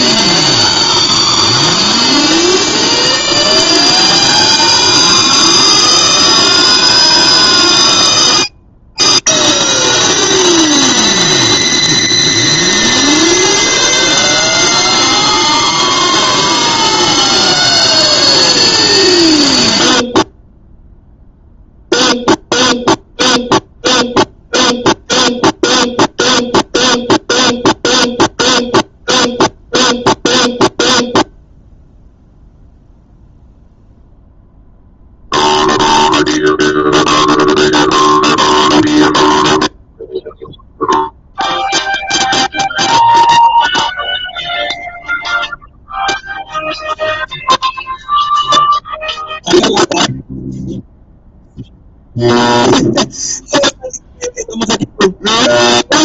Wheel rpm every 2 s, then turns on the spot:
0, 0, 0, 0, 0, 0, 0, 0, 0, 0, 0, 0, 0, 0, 0, 0, 0, 0, 0, 0, 0, 0, 0, 0, 0, 0, 0, 0.
none